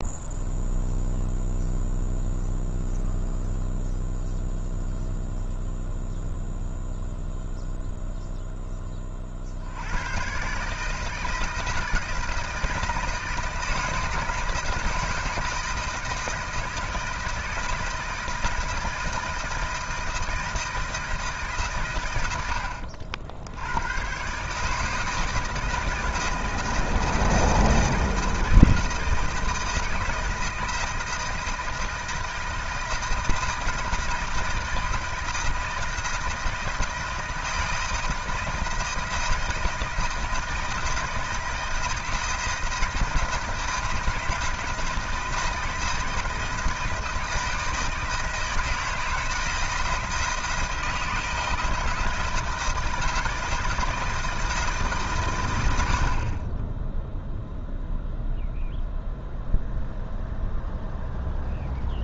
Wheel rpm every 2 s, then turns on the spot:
0, 0, 0, 0, 10, 150, 160, 160, 160, 160, 160, 80, 150, 160, 160, 170, 170, 160, 160, 160, 160, 160, 160, 170, 160, 170, 160, 160, 10, 0, 0.
none